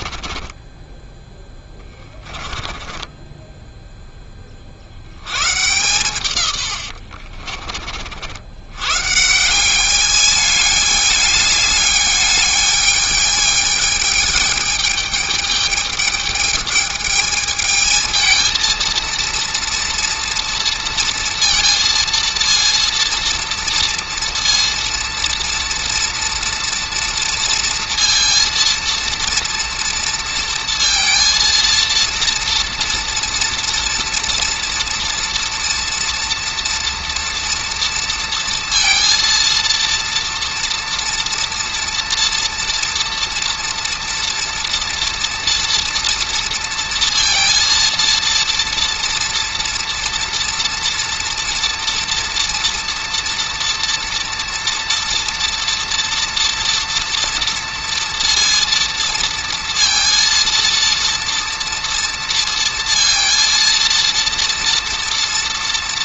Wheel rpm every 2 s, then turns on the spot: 10, 20, 60, 80, 120, 210, 210, 210, 210, 230, 230, 230, 230, 240, 230, 230, 230, 240, 240, 230, 240, 230, 230, 230, 230, 230, 230, 230, 230, 230, 230, 230, 230.
0-4 6-8